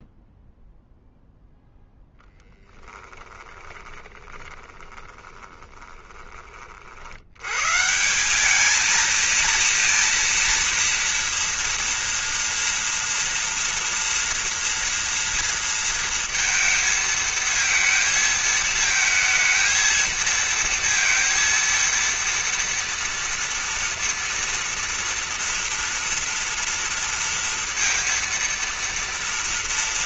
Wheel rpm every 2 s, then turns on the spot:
0, 10, 20, 30, 200, 230, 230, 230, 230, 220, 230, 230, 240, 230, 230.
2-6